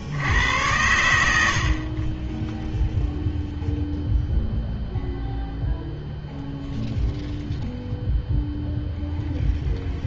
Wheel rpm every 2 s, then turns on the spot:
100, 0, 0, 0, 0.
none